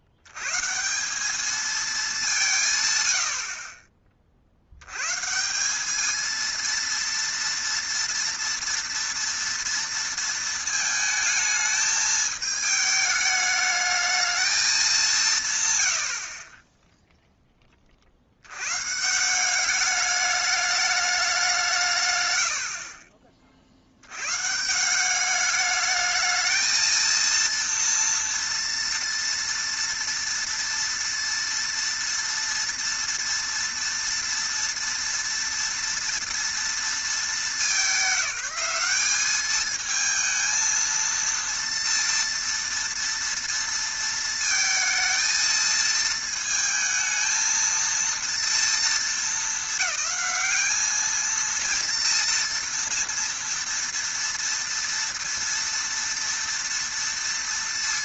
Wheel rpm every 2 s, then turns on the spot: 80, 180, 60, 230, 230, 220, 220, 210, 30, 100, 210, 80, 140, 220, 230, 230, 230, 230, 230, 190, 220, 230, 230, 220, 230, 210, 230, 230, 230.
16-18 22-24